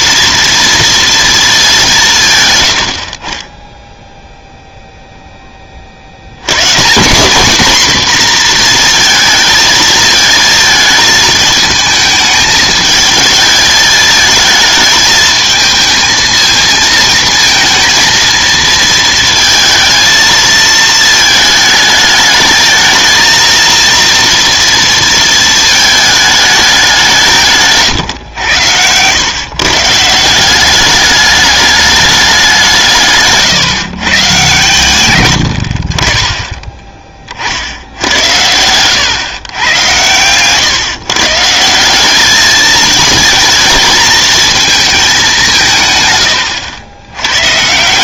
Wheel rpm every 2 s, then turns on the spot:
230, 100, 0, 130, 230, 220, 220, 220, 220, 230, 220, 220, 230, 200, 100, 190, 170, 120, 20, 100, 130, 220, 220, 100.
38-40